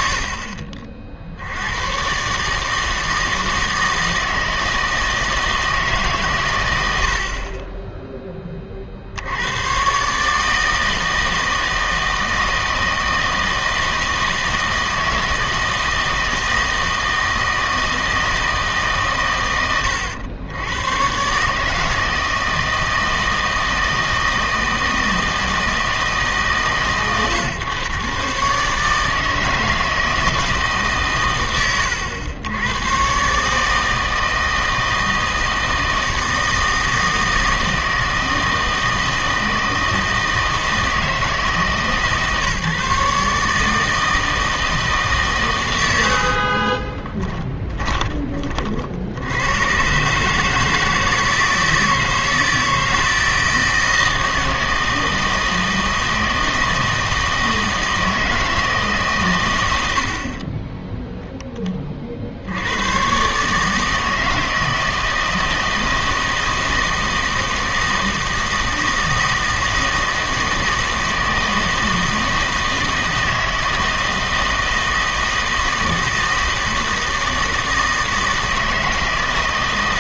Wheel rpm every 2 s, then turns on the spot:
40, 150, 160, 110, 40, 160, 160, 160, 160, 150, 110, 160, 160, 140, 150, 150, 110, 160, 160, 160, 160, 150, 160, 30, 50, 160, 160, 160, 160, 150, 10, 90, 160, 160, 160, 160, 160, 160, 160, 160.
46-48